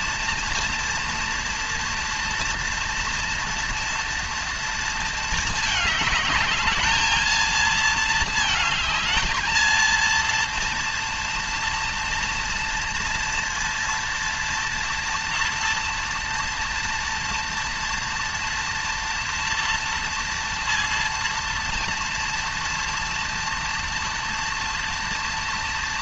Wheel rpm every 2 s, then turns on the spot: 230, 230, 230, 210, 220, 230, 230, 230, 230, 240, 230, 230, 230.
none